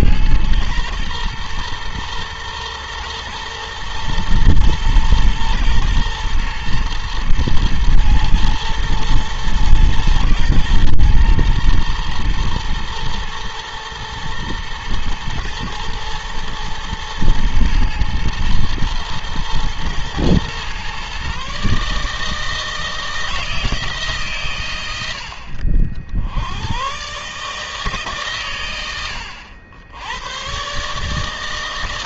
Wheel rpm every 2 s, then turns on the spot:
100, 120, 120, 120, 110, 120, 120, 110, 110, 110, 120, 160, 110, 90, 120, 120.
none